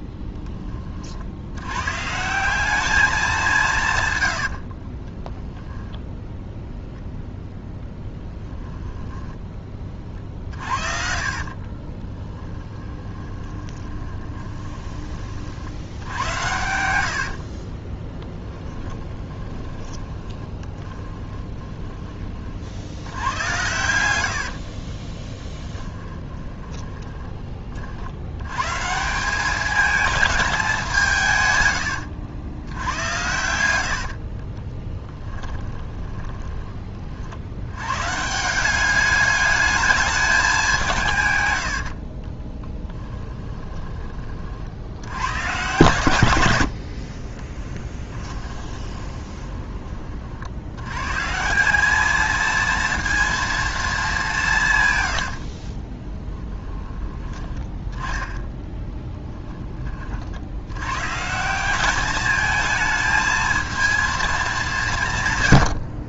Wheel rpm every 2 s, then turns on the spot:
20, 200, 50, 0, 10, 50, 10, 20, 90, 20, 20, 60, 50, 30, 140, 190, 90, 30, 30, 190, 180, 10, 60, 60, 20, 90, 230, 130, 20, 10, 100, 220, 170.
4-6 8-14 16-22 24-28 32-36 42-44 48-50 56-58